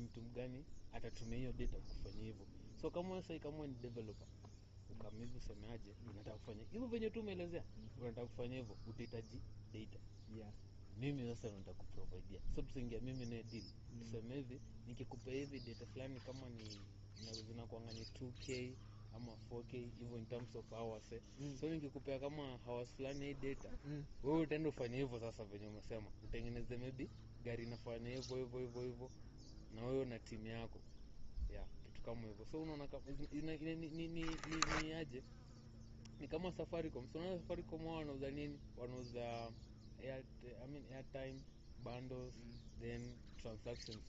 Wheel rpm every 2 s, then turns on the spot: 0, 0, 0, 0, 0, 0, 0, 0, 0, 0, 0, 0, 0, 0, 0, 0, 0, 0, 0, 0, 0, 0.
none